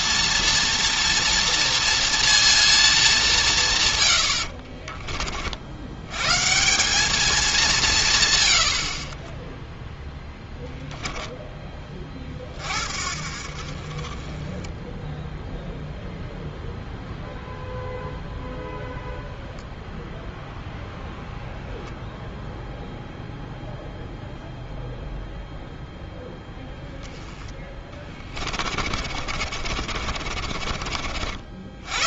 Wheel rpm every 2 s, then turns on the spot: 230, 230, 60, 140, 110, 10, 40, 20, 0, 0, 0, 0, 0, 10, 30, 40.
4-6 28-32